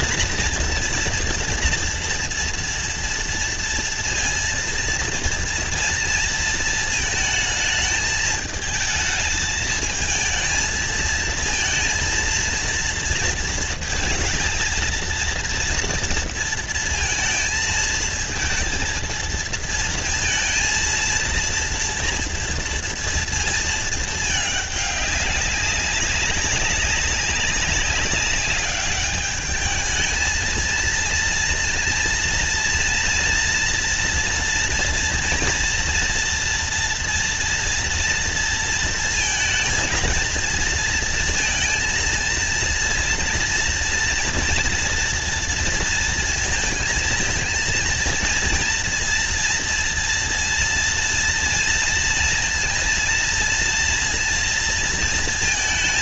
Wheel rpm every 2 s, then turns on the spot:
240, 230, 230, 230, 220, 220, 230, 230, 230, 230, 220, 230, 210, 200, 200, 230, 230, 230, 230, 230, 230, 230, 230, 230, 230, 230, 230, 230.
none